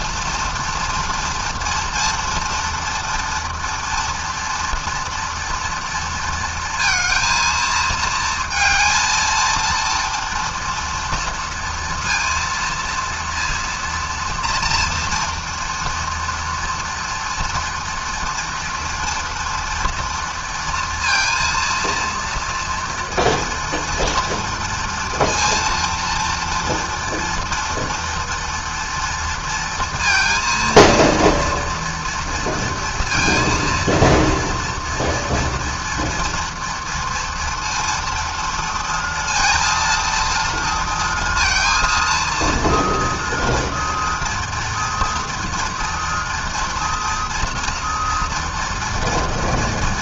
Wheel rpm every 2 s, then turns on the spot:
230, 230, 240, 230, 230, 240, 230, 230, 240, 230, 230, 230, 230, 230, 240, 230, 230, 230, 240, 230, 230, 230, 230, 230, 230.
none